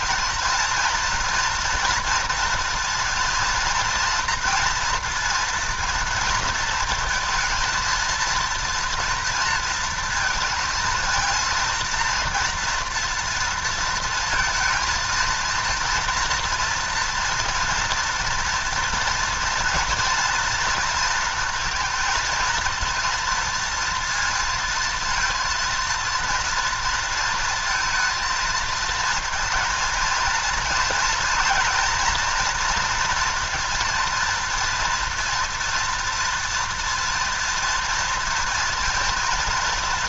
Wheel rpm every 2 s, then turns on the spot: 230, 230, 230, 220, 230, 230, 230, 230, 230, 230, 230, 230, 230, 230, 220, 230, 230, 230, 230, 230.
none